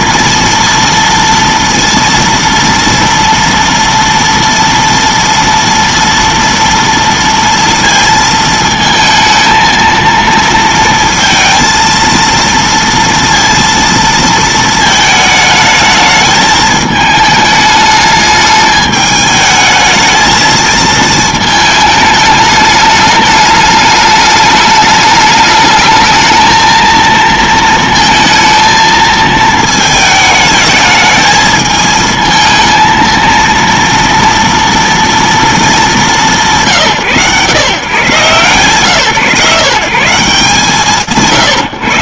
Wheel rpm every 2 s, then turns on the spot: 230, 230, 230, 230, 230, 230, 230, 230, 220, 210, 210, 220, 210, 210, 230, 220, 220, 230, 220, 120, 140.
none